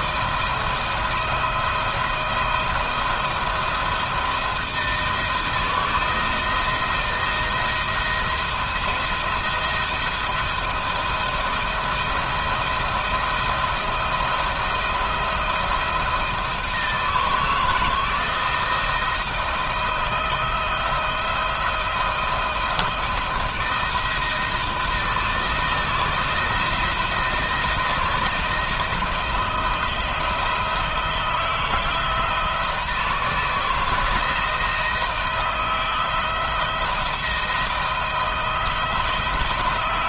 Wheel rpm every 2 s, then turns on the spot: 170, 160, 170, 170, 170, 170, 160, 170, 160, 160, 160, 160, 160, 160, 160, 160, 160, 160, 170, 160.
none